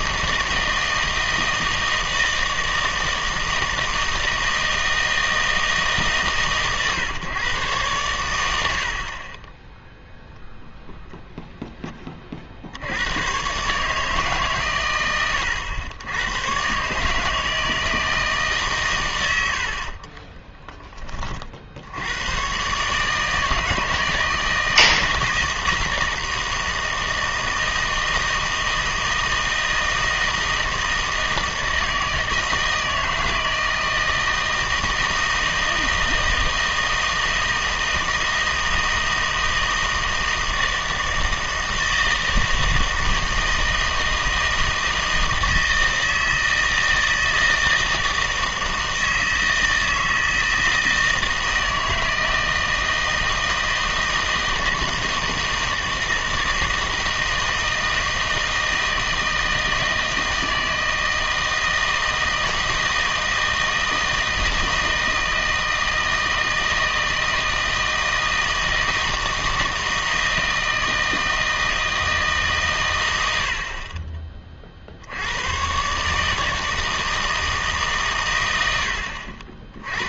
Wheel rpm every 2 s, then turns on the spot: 160, 160, 160, 140, 90, 0, 60, 130, 120, 150, 10, 130, 160, 160, 160, 160, 160, 160, 160, 160, 160, 160, 160, 160, 160, 160, 160, 160, 160, 160, 160, 160, 160, 160, 160, 160, 140, 40, 160, 90.
none